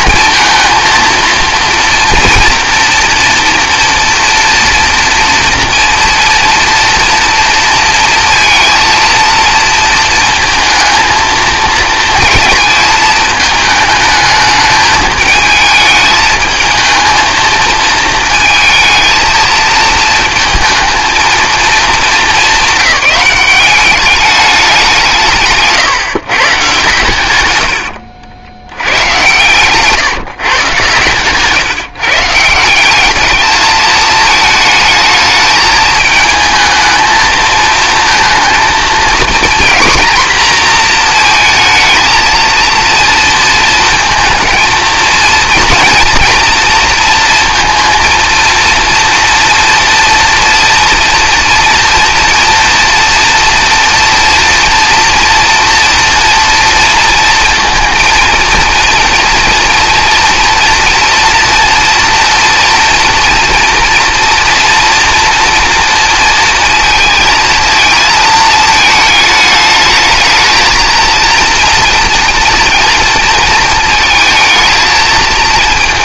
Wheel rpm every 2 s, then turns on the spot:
230, 230, 230, 230, 230, 230, 220, 210, 220, 220, 230, 190, 190, 140, 90, 120, 170, 220, 220, 230, 230, 230, 220, 230, 230, 230, 230, 230, 230, 230, 230, 230, 230, 230, 220, 230, 230, 220.
none